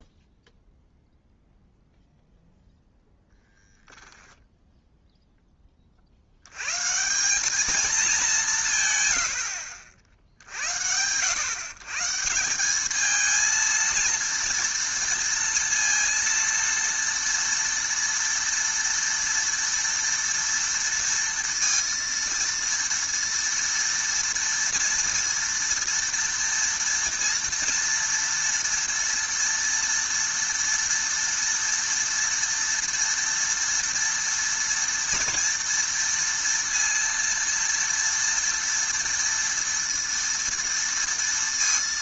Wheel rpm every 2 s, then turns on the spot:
0, 0, 0, 130, 150, 70, 190, 230, 230, 230, 230, 230, 230, 230, 230, 230, 230, 230, 230, 230, 230.
none